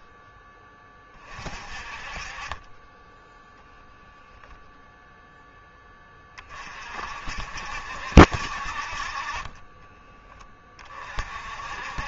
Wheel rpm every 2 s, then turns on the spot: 20, 10, 0, 50, 60, 40.
none